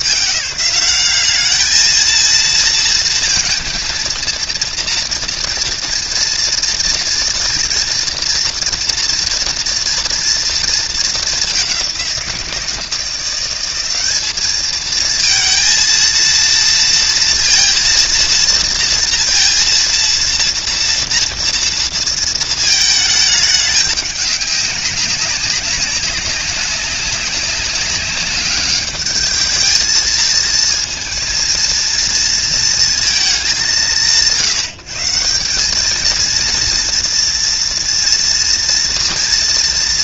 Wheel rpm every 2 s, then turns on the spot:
150, 220, 230, 230, 230, 220, 170, 210, 230, 230, 230, 220, 190, 200, 210, 220, 230, 160, 230, 230.
none